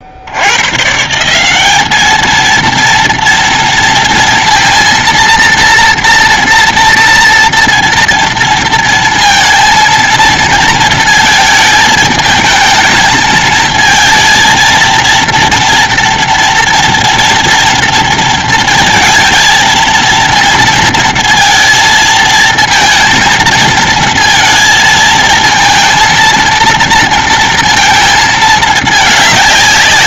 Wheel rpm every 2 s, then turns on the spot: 80, 220, 230, 240, 230, 230, 220, 230, 230, 230, 230, 220, 230, 230, 220.
none